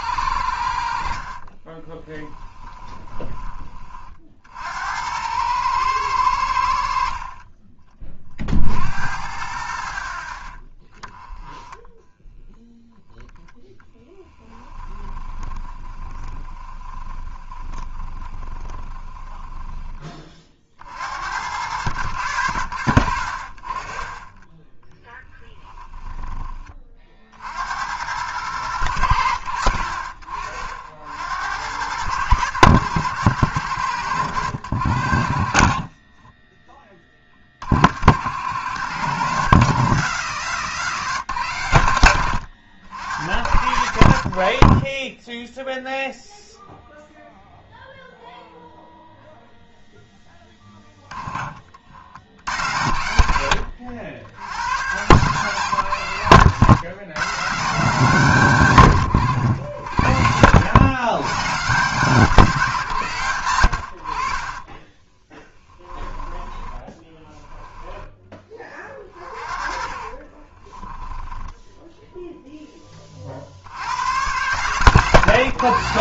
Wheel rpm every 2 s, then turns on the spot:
70, 20, 70, 70, 60, 40, 10, 10, 20, 20, 50, 90, 20, 30, 100, 60, 110, 90, 20, 110, 150, 90, 50, 0, 0, 10, 80, 100, 150, 140, 130, 160, 20, 20, 30, 20, 10, 140.
0-4 14-20 50-52 64-68 70-72